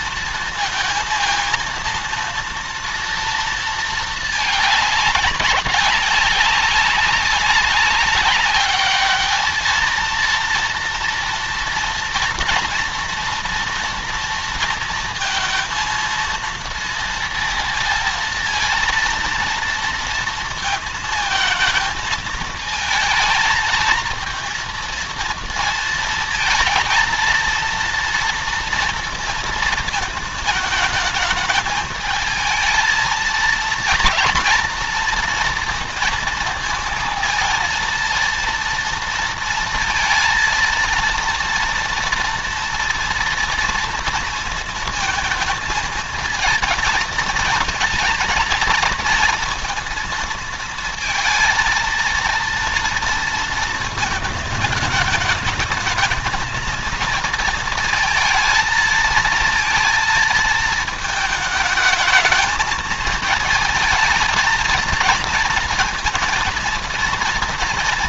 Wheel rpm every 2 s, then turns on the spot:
230, 230, 210, 200, 210, 230, 230, 230, 230, 230, 220, 220, 230, 230, 230, 220, 220, 230, 230, 230, 230, 230, 230, 220, 230, 230, 230, 220, 230, 220, 220, 220, 220, 230.
none